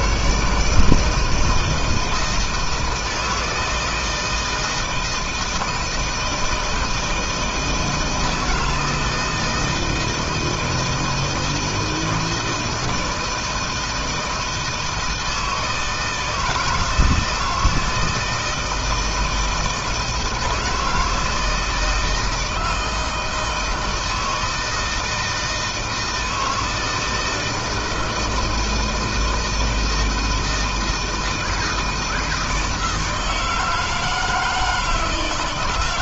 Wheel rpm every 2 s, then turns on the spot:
150, 160, 160, 160, 160, 160, 160, 160, 160, 160, 160, 160, 160, 160, 160, 160, 160, 160.
none